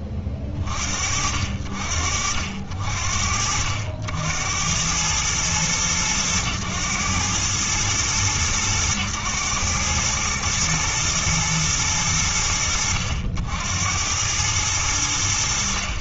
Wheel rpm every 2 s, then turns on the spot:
30, 60, 90, 110, 100, 110, 70, 90.
none